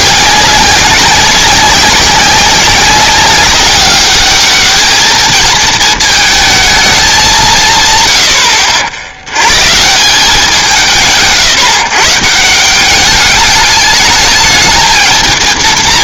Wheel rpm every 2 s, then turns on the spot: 200, 190, 210, 220, 70, 180, 180, 220.
none